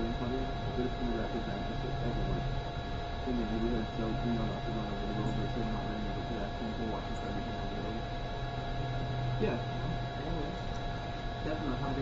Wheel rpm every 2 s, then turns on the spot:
0, 0, 0, 0, 0, 0.
none